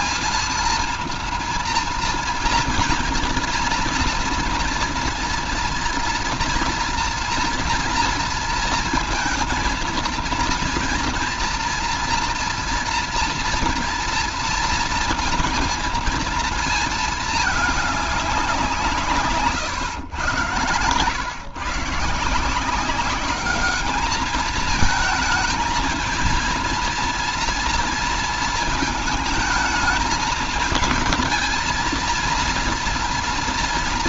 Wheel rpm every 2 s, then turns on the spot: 230, 230, 240, 240, 230, 230, 230, 230, 230, 190, 120, 160, 220, 230, 230, 220, 230.
none